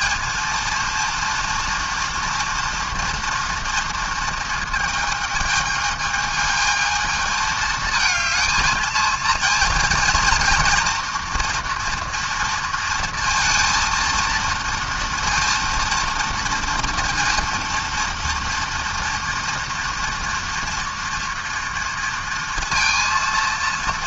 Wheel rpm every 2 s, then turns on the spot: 230, 230, 230, 220, 220, 240, 230, 230, 230, 230, 240, 230.
none